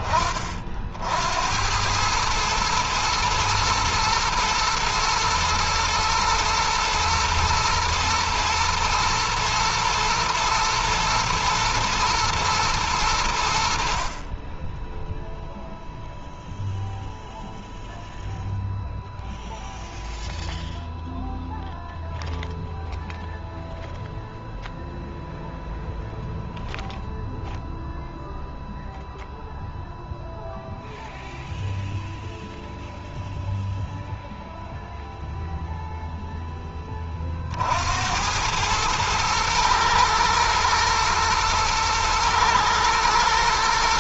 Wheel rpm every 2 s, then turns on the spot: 70, 110, 110, 120, 110, 110, 100, 10, 0, 0, 0, 0, 0, 0, 0, 0, 0, 0, 20, 110, 110, 110.
none